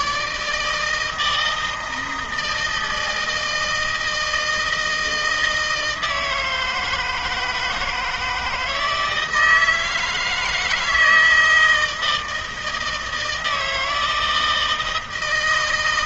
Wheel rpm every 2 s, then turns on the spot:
150, 160, 160, 160, 160, 160, 160, 160.
none